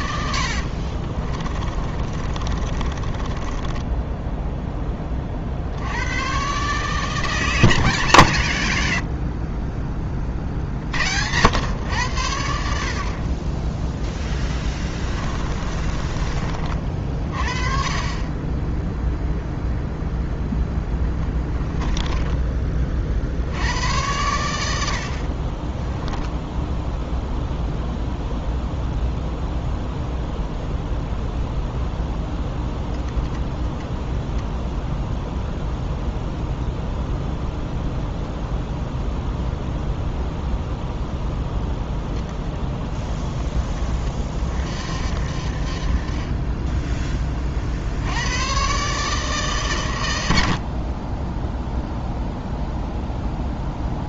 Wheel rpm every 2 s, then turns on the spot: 60, 30, 10, 150, 90, 70, 70, 20, 40, 0, 10, 30, 80, 0, 0, 0, 0, 0, 0, 0, 0, 20, 60, 10, 140, 50, 0.
0-4 14-16